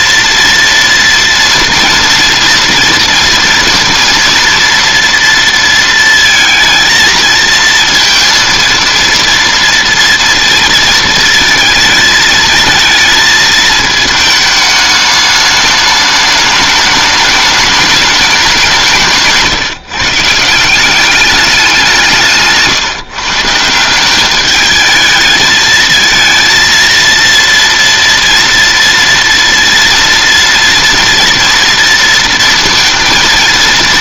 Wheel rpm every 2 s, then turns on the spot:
240, 230, 230, 230, 230, 230, 220, 210, 210, 190, 170, 150, 210, 230, 230, 230, 230.
none